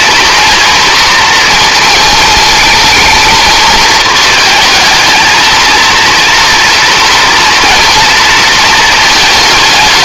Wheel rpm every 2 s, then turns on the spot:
230, 220, 220, 230, 220.
none